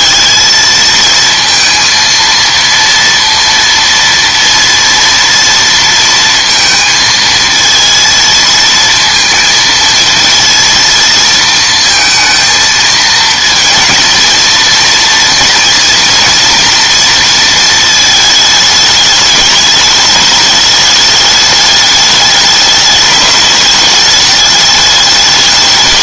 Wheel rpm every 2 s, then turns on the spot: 220, 230, 230, 230, 230, 230, 230, 230, 240, 210, 210, 210, 210.
none